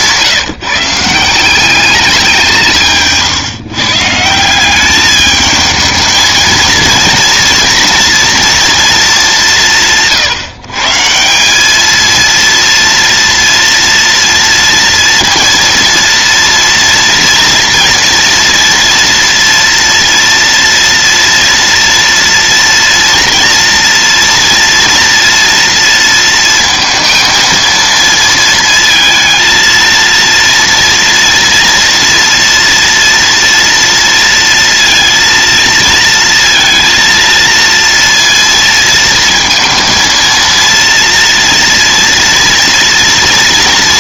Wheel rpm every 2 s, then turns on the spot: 170, 160, 200, 230, 220, 150, 230, 230, 230, 230, 230, 230, 230, 230, 220, 230, 230, 230, 230, 230, 230, 230.
none